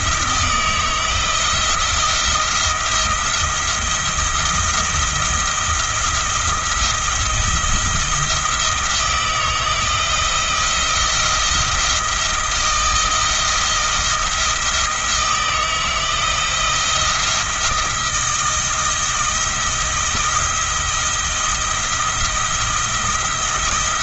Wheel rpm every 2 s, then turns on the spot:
170, 170, 170, 170, 170, 170, 170, 160, 170, 170, 170, 170.
none